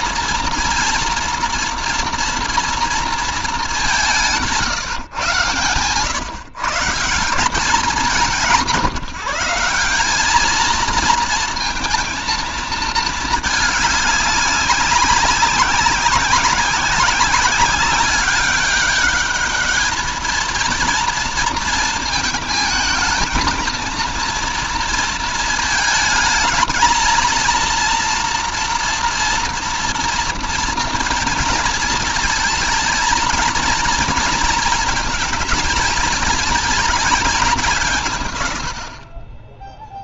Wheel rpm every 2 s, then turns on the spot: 230, 230, 160, 160, 180, 220, 220, 190, 190, 200, 230, 230, 230, 220, 240, 230, 230, 230, 220, 50.
none